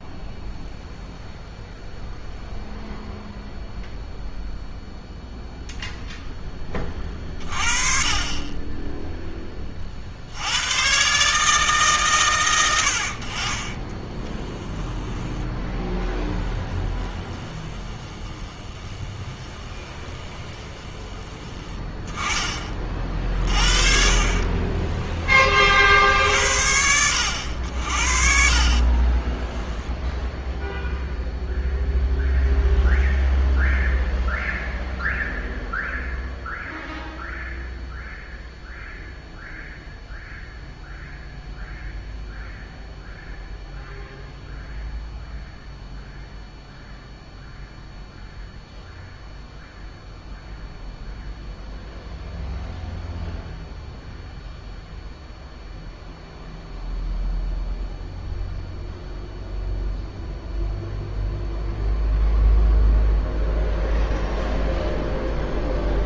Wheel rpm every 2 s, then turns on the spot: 0, 0, 0, 20, 10, 120, 90, 10, 20, 20, 20, 40, 20, 70, 40, 0, 0, 0, 0, 0, 0, 0, 0, 0, 0, 0, 0, 0, 0, 0, 0, 0, 0.
16-22 24-26 28-30